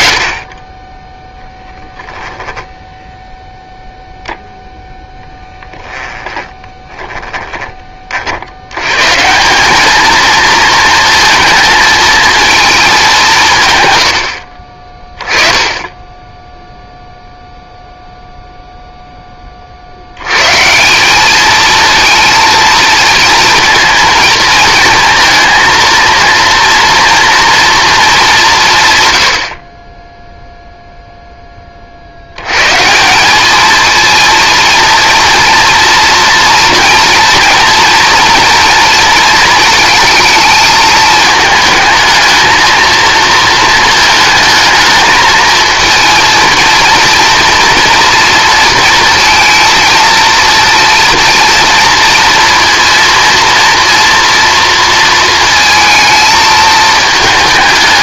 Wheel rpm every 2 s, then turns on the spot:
0, 0, 0, 10, 100, 230, 220, 40, 0, 0, 170, 230, 220, 230, 160, 0, 140, 230, 240, 230, 220, 220, 220, 230, 230, 230, 230, 230, 220.
6-8